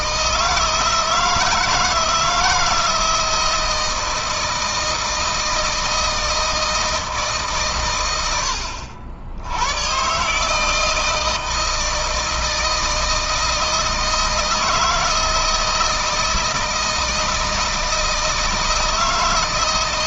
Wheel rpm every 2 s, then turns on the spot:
160, 160, 160, 160, 80, 160, 160, 160, 160, 160.
none